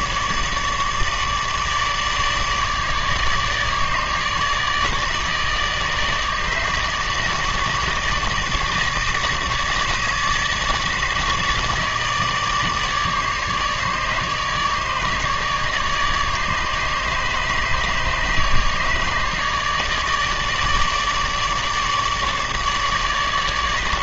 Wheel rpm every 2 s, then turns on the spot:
150, 150, 150, 150, 150, 150, 150, 150, 150, 150, 150, 150.
none